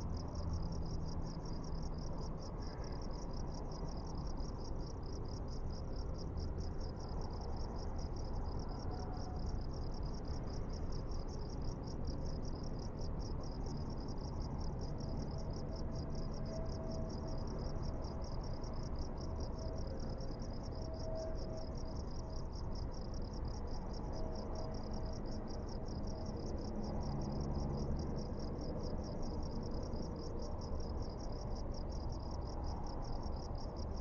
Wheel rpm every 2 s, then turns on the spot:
0, 0, 0, 0, 0, 0, 0, 0, 0, 0, 0, 0, 0, 0, 0, 0, 0.
none